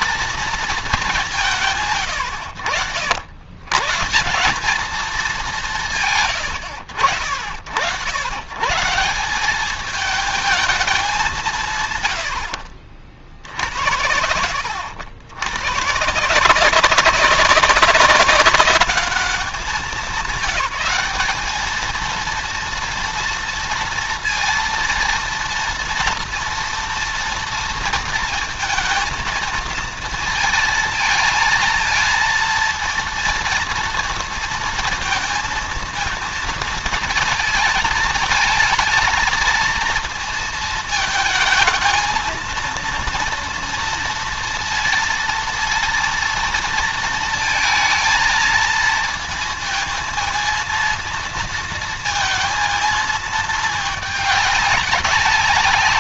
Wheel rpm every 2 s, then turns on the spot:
220, 100, 200, 100, 130, 210, 70, 80, 180, 200, 200, 230, 230, 230, 230, 230, 230, 230, 220, 220, 220, 230, 230, 230, 230, 230, 230, 200.
12-14